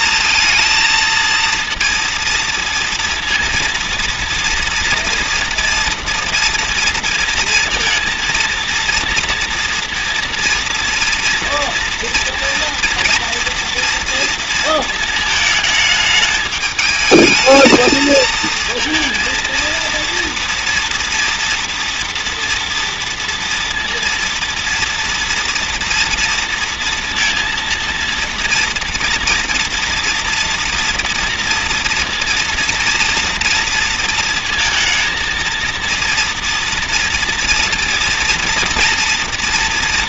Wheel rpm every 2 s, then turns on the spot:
230, 230, 230, 230, 230, 230, 230, 230, 210, 220, 240, 230, 230, 230, 230, 230, 230, 230, 230, 230.
none